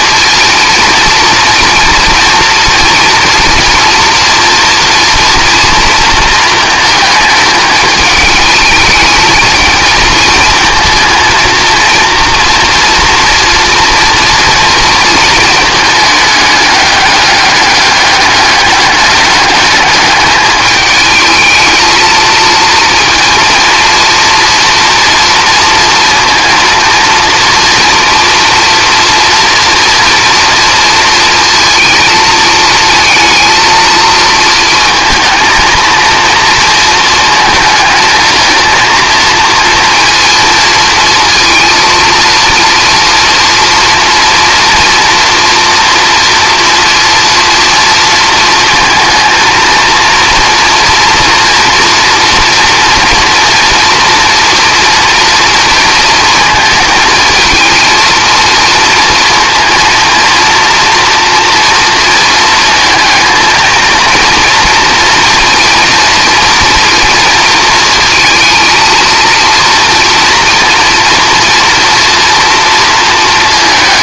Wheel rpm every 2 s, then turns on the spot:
220, 230, 230, 220, 210, 220, 230, 230, 200, 200, 210, 230, 230, 230, 230, 230, 220, 230, 230, 220, 230, 230, 240, 230, 230, 230, 230, 240, 230, 230, 230, 230, 230, 230, 220, 230, 230.
none